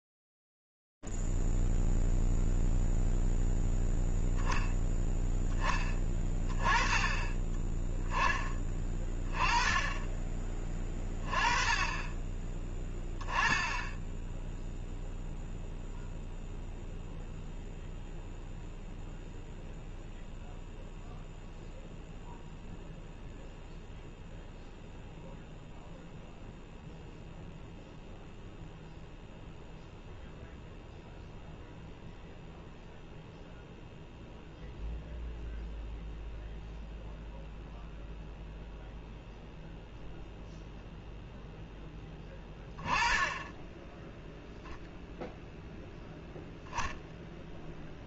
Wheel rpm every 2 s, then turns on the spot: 0, 0, 0, 30, 10, 20, 20, 10, 0, 0, 0, 0, 0, 0, 0, 0, 0, 0, 0, 0, 0, 10, 0, 0.
none